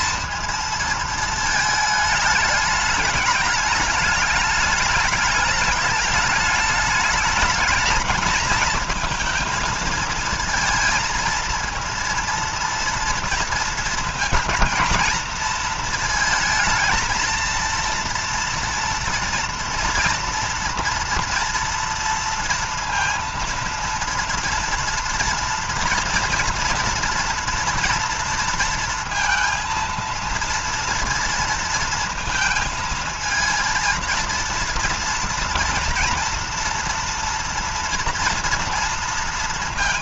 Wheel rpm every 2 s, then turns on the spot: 230, 210, 210, 210, 230, 230, 230, 230, 230, 230, 230, 230, 230, 230, 230, 230, 220, 230, 230, 230.
none